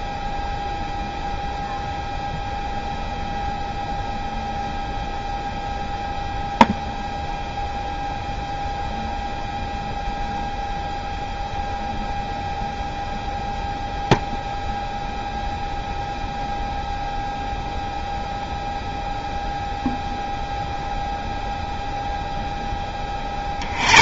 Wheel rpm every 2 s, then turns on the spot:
0, 0, 0, 0, 0, 0, 0, 0, 0, 0, 0, 10.
none